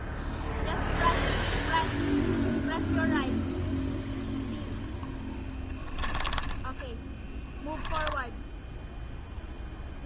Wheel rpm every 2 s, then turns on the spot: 0, 0, 0, 10, 0.
6-8